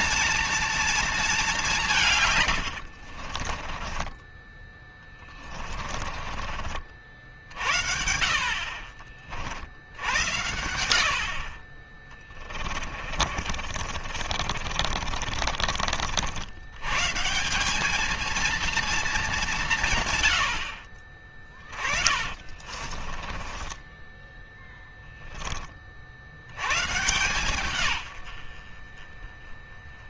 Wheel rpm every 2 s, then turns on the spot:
230, 70, 20, 50, 50, 60, 30, 50, 140, 220, 50, 40, 10, 120, 40.
2-6 12-16 22-24